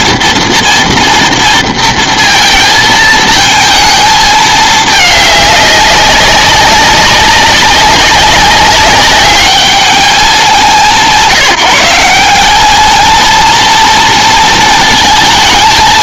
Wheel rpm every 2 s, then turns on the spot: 230, 220, 210, 190, 200, 180, 200, 230.
none